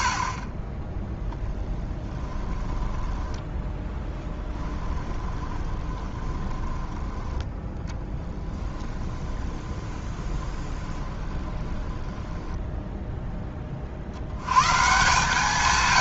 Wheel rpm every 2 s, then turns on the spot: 40, 10, 10, 20, 10, 20, 10, 90.
0-14